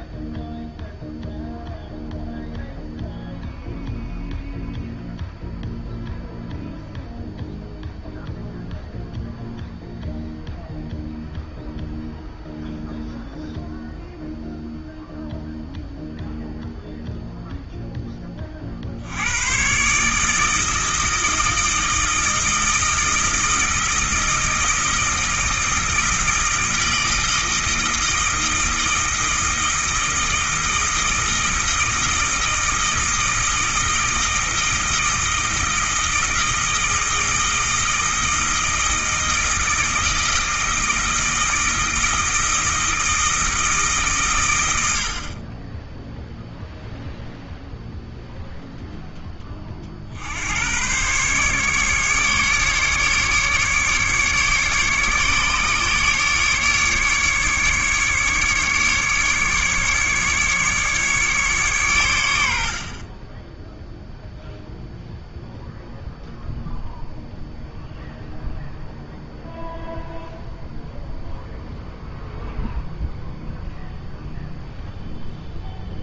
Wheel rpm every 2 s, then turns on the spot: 0, 0, 0, 0, 0, 0, 0, 0, 0, 60, 160, 160, 160, 160, 160, 160, 160, 160, 160, 160, 160, 160, 90, 0, 0, 110, 140, 140, 140, 150, 140, 50, 0, 0, 0, 0, 0, 0.
none